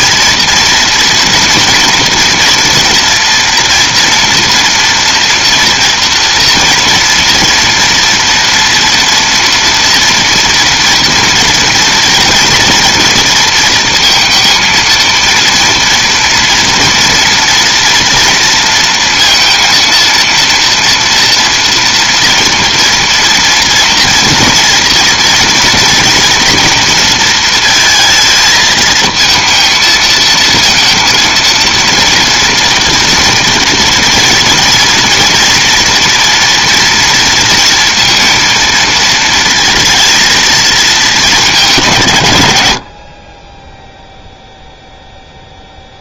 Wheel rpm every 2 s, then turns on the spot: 230, 230, 240, 230, 230, 230, 240, 230, 230, 230, 230, 230, 240, 230, 220, 230, 230, 230, 230, 230, 230, 90, 0.
none